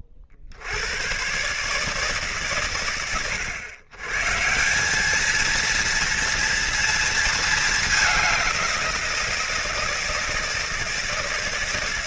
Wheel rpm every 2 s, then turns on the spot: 40, 120, 150, 230, 190, 160.
none